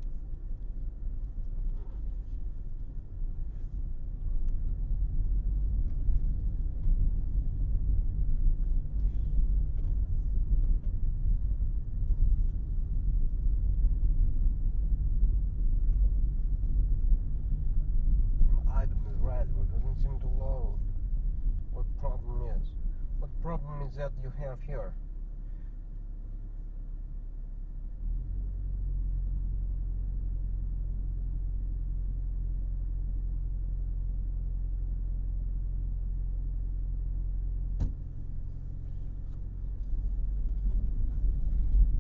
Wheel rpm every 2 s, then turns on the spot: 0, 0, 0, 0, 0, 0, 0, 0, 0, 0, 0, 0, 0, 0, 0, 0, 0, 0, 0, 0, 0.
none